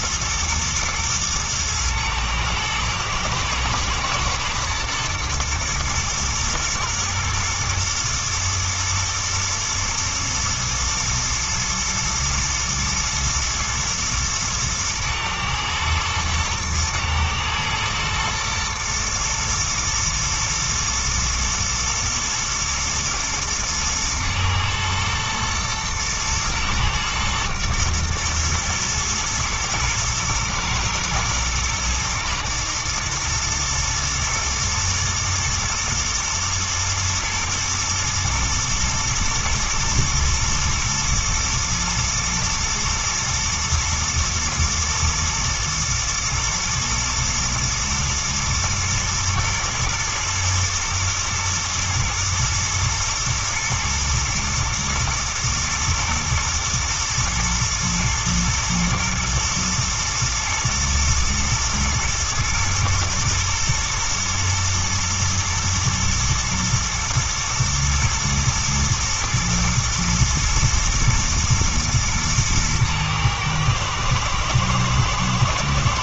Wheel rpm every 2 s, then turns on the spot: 110, 110, 110, 110, 120, 120, 120, 110, 110, 110, 110, 110, 110, 110, 110, 120, 120, 110, 120, 110, 120, 120, 110, 120, 120, 110, 110, 120, 120, 110, 110, 120, 120, 120, 110, 110, 110, 110.
none